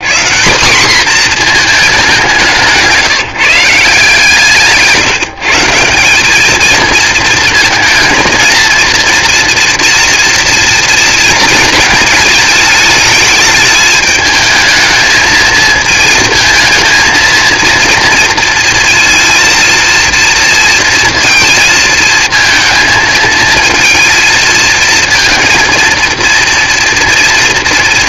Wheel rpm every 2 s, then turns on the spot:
230, 170, 160, 230, 230, 230, 210, 220, 230, 230, 230, 220, 230, 230.
none